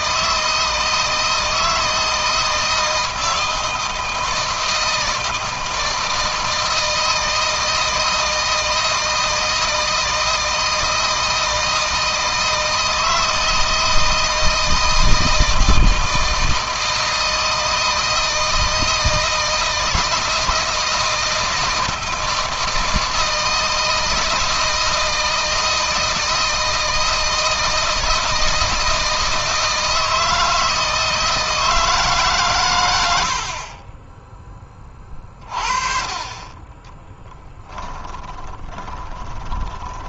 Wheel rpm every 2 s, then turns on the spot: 160, 160, 160, 160, 160, 160, 160, 160, 160, 160, 160, 160, 160, 160, 160, 160, 90, 30, 20, 30.
36-40